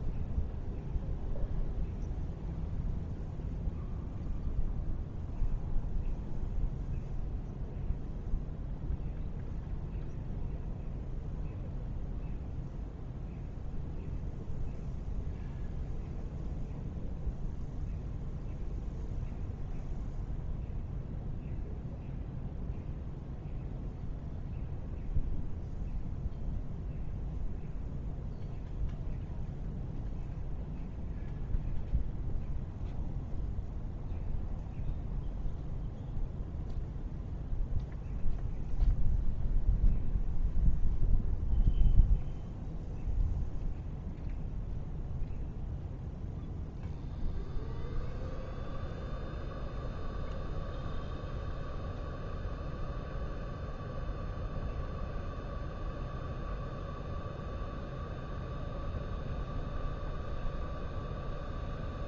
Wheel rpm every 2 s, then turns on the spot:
0, 0, 0, 0, 0, 0, 0, 0, 0, 0, 0, 0, 0, 0, 0, 0, 0, 0, 0, 0, 0, 0, 0, 0, 0, 0, 0, 0, 0, 0, 0.
none